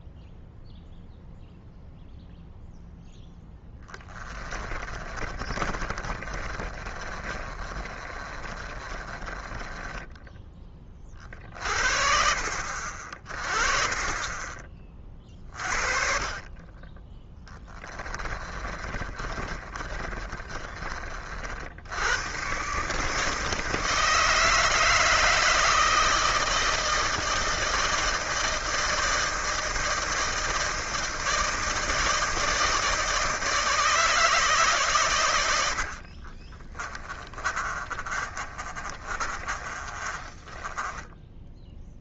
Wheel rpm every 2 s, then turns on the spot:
0, 0, 20, 30, 30, 20, 50, 30, 30, 30, 30, 130, 160, 160, 160, 160, 160, 140, 30, 30, 20.
4-10 18-20 36-42